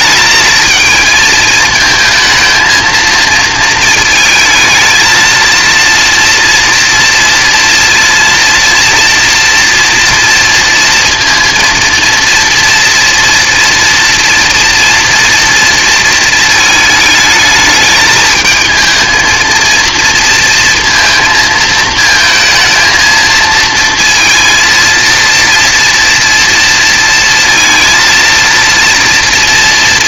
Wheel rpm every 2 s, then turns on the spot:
220, 230, 220, 230, 230, 230, 230, 230, 220, 220, 230, 220, 230, 230, 230.
none